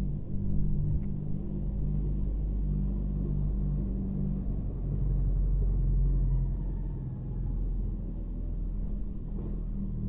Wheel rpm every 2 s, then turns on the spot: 0, 0, 0, 0, 0.
none